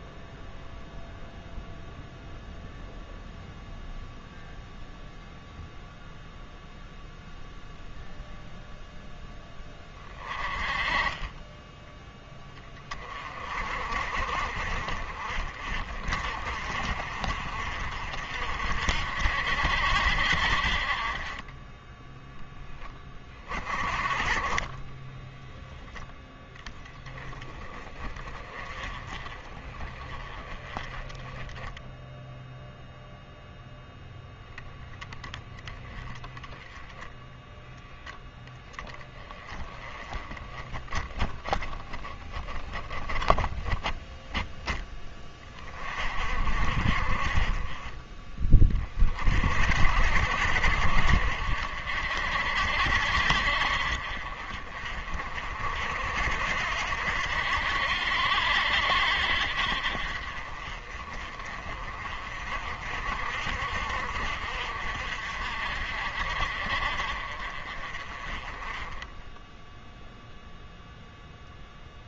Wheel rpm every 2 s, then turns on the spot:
0, 0, 0, 0, 0, 20, 20, 40, 40, 60, 40, 10, 20, 20, 20, 10, 0, 10, 10, 10, 20, 10, 10, 40, 30, 60, 60, 40, 60, 60, 30, 50, 50, 40, 20, 0.
24-26